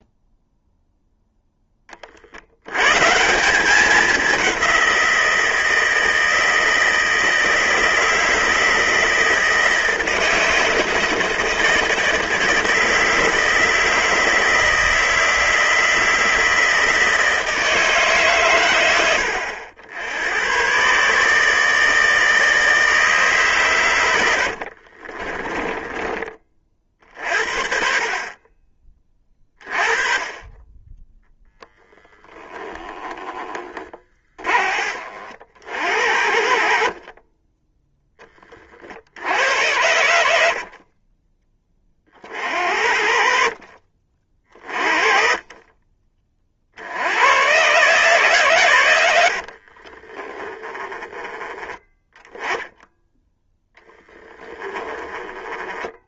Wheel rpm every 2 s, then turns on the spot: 0, 140, 180, 160, 160, 160, 160, 160, 160, 90, 140, 150, 30, 40, 30, 10, 10, 50, 30, 60, 30, 60, 30, 90, 90, 10, 0, 10.
24-26 40-42 44-46 48-50